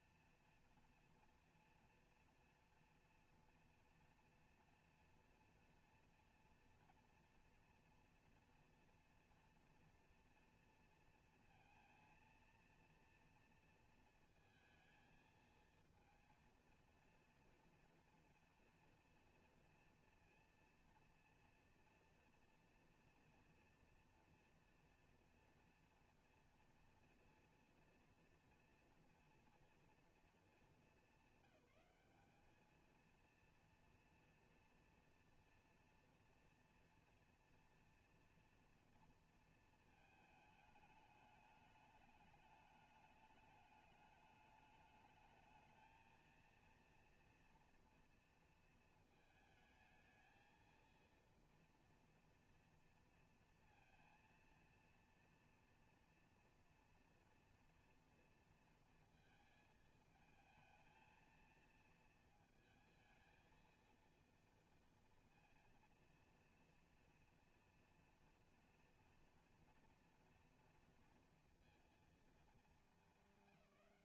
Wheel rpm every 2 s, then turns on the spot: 240, 230, 240, 230, 240, 230, 230, 230, 230, 230, 230, 230, 230, 240, 230, 200, 230, 230, 240, 230, 210, 210, 210, 230, 220, 230, 230, 230, 230, 230, 230, 220, 230, 230, 230, 230, 200.
none